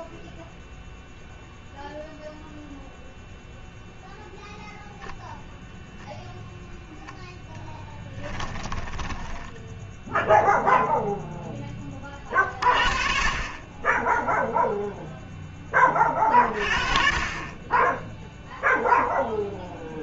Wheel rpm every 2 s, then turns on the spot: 0, 0, 0, 0, 10, 0, 20, 0, 40, 0.
8-10